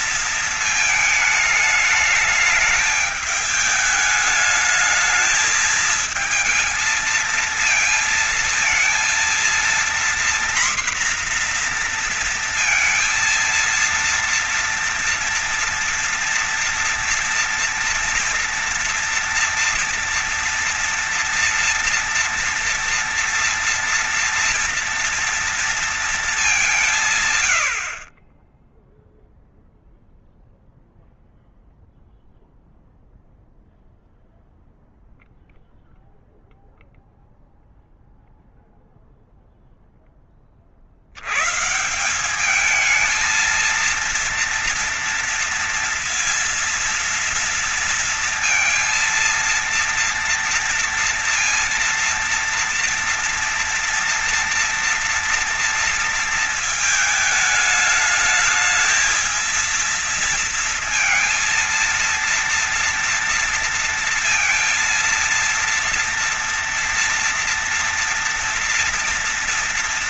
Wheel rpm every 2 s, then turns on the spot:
230, 210, 210, 220, 230, 240, 230, 230, 230, 230, 230, 230, 230, 210, 30, 0, 0, 0, 0, 0, 20, 190, 230, 230, 230, 230, 230, 230, 230, 210, 230, 230, 230, 230, 230.
none